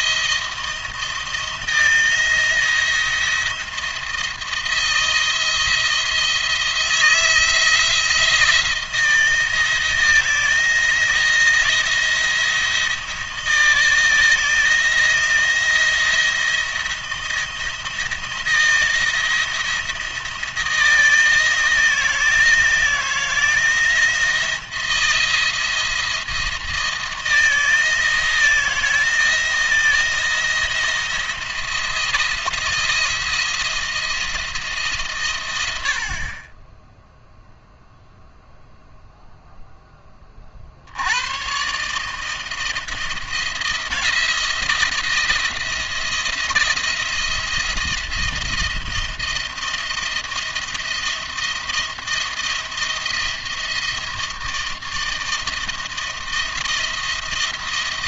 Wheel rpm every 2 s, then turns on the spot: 170, 170, 170, 160, 170, 170, 170, 170, 170, 170, 170, 160, 170, 170, 170, 170, 170, 160, 30, 0, 50, 160, 170, 160, 170, 170, 170, 170, 170.
none